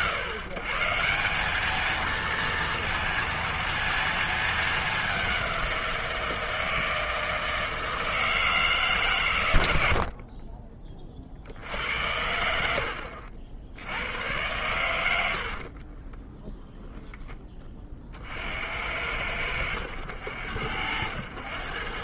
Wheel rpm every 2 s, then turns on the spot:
140, 230, 210, 160, 160, 40, 80, 100, 10, 80, 80.
16-18